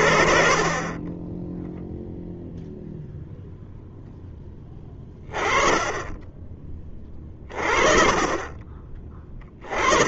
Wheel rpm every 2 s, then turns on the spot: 10, 0, 20, 30, 20.
none